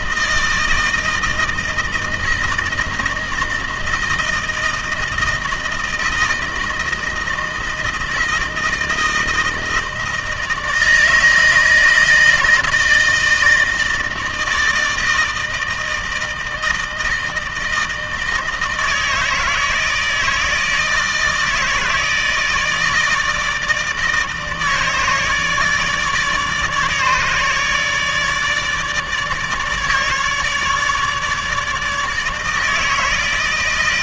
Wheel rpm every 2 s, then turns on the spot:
160, 160, 160, 160, 160, 160, 160, 160, 160, 160, 160, 160, 150, 150, 150, 150, 160.
none